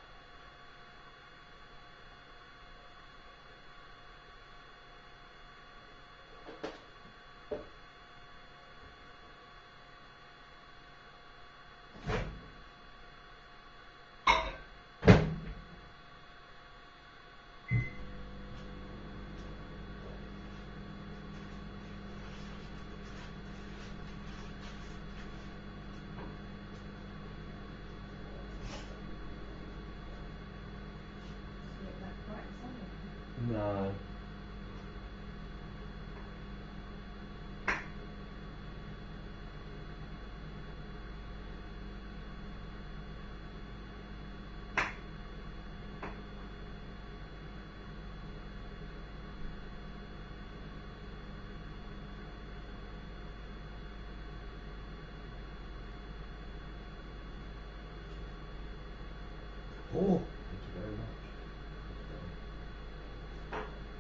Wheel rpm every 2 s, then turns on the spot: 0, 0, 0, 0, 0, 0, 0, 0, 0, 0, 0, 0, 0, 0, 0, 0, 0, 0, 0, 0, 0, 0, 0, 0, 0, 0, 0, 0, 0, 0, 0, 0.
none